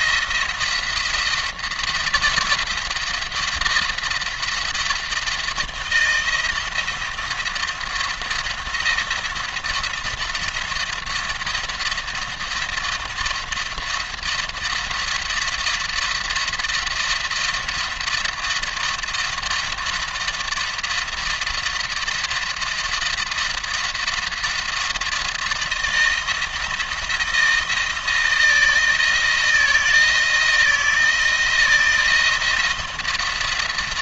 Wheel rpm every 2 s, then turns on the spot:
170, 170, 170, 160, 170, 170, 170, 170, 170, 170, 170, 170, 170, 170, 160, 160, 170.
none